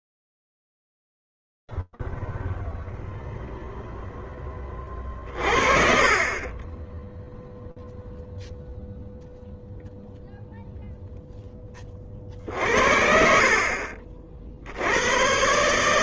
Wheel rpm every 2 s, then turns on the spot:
0, 0, 0, 30, 0, 0, 50, 70.
none